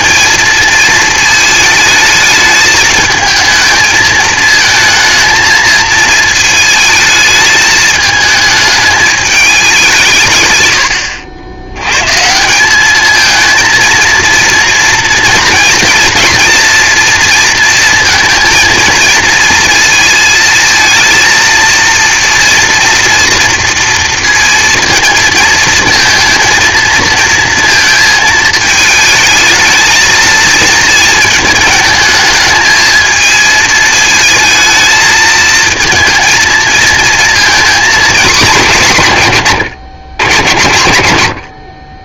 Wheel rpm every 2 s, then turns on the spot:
220, 220, 230, 220, 210, 100, 190, 230, 230, 230, 230, 230, 230, 220, 220, 220, 220, 220, 230, 170, 100.
none